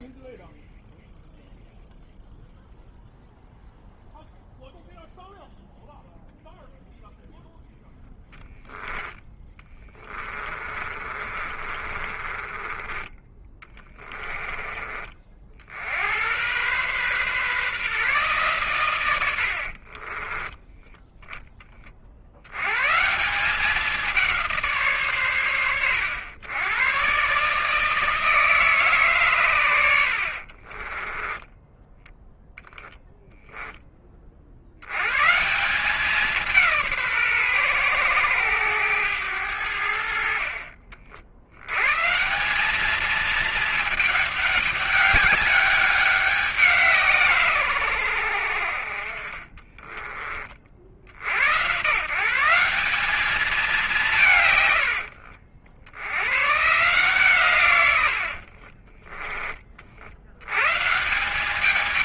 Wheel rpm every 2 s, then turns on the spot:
0, 0, 0, 0, 0, 20, 20, 20, 100, 120, 10, 90, 170, 100, 160, 50, 10, 50, 180, 110, 60, 170, 210, 180, 80, 30, 150, 150, 100, 70, 90.
10-14 30-34 58-60